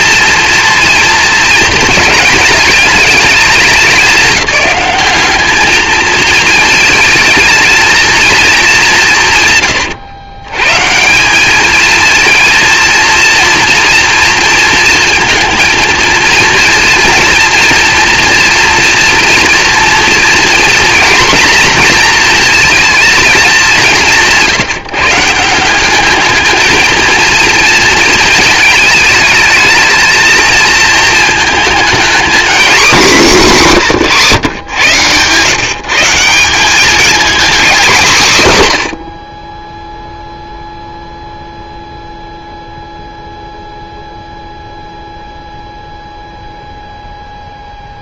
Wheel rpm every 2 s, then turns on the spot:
230, 220, 190, 220, 210, 130, 230, 230, 230, 230, 240, 230, 160, 220, 220, 230, 230, 120, 190, 140, 0, 0, 0, 0.
none